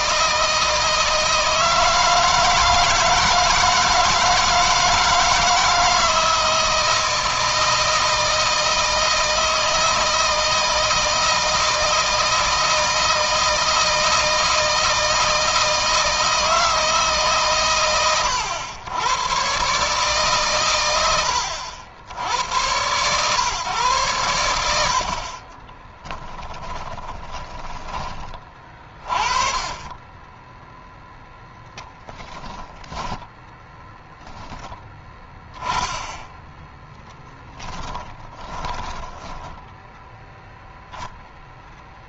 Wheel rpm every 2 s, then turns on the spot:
160, 160, 160, 160, 160, 160, 160, 160, 160, 110, 140, 80, 100, 10, 30, 20, 10, 10, 10, 10, 0.
26-28 38-40